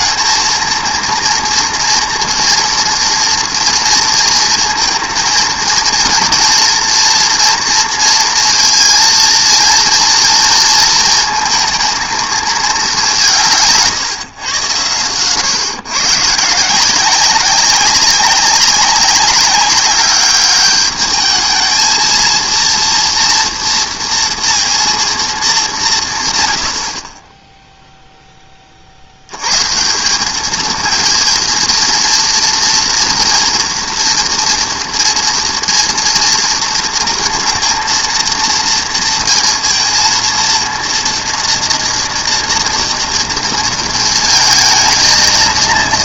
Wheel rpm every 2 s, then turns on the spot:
230, 230, 230, 230, 230, 230, 210, 120, 160, 190, 210, 230, 240, 100, 30, 220, 230, 230, 230, 230, 230, 230, 220.
none